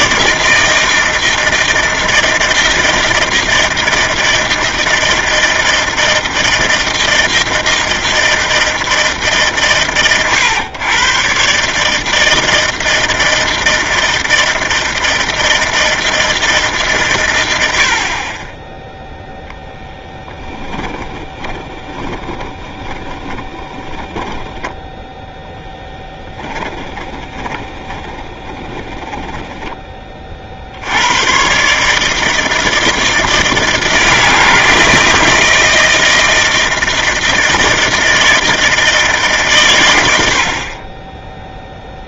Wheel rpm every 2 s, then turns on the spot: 160, 160, 160, 160, 160, 120, 160, 160, 150, 10, 10, 20, 10, 30, 20, 100, 160, 160, 160, 150, 10.
20-24 26-30